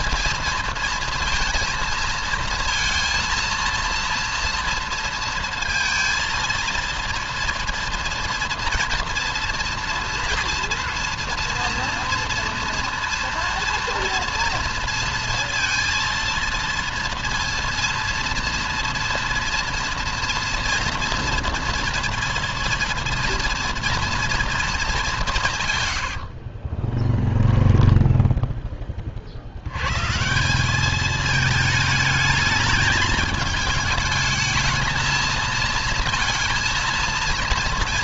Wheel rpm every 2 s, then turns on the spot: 230, 230, 230, 230, 230, 230, 230, 230, 230, 230, 230, 230, 210, 30, 30, 200, 210, 220, 230.
26-28